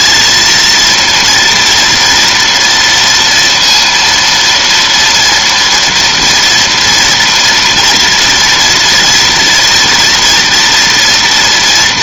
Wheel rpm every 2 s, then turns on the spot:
230, 230, 230, 240, 230, 230.
none